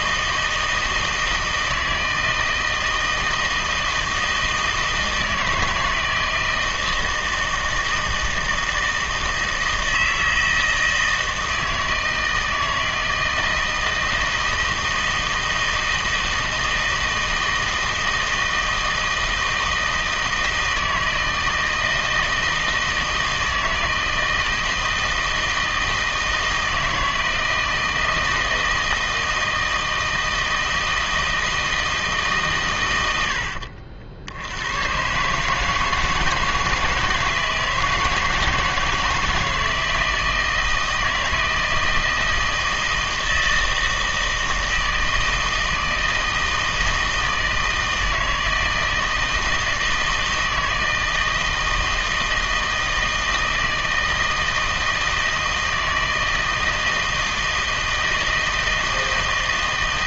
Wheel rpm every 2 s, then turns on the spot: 160, 160, 160, 160, 160, 160, 160, 160, 160, 160, 160, 160, 160, 160, 160, 160, 120, 110, 160, 160, 160, 160, 160, 160, 160, 160, 160, 160, 160, 160.
none